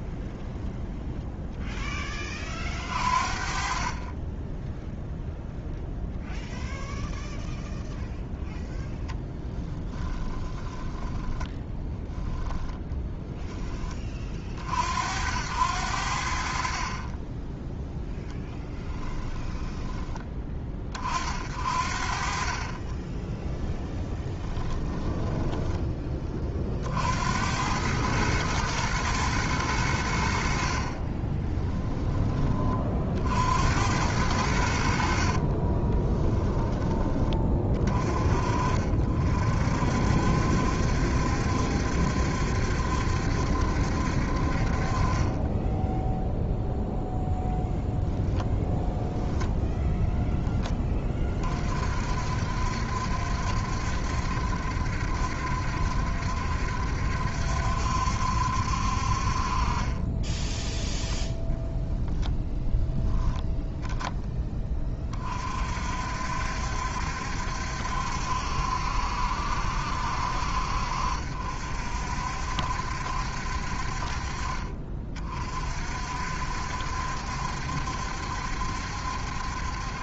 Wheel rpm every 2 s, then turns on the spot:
0, 30, 0, 0, 0, 10, 0, 70, 30, 10, 40, 20, 10, 60, 110, 30, 60, 50, 20, 50, 70, 70, 30, 0, 10, 20, 70, 70, 70, 50, 10, 0, 30, 70, 70, 60, 70, 30, 70, 70.
10-12 18-20 22-26 30-32 34-36 60-62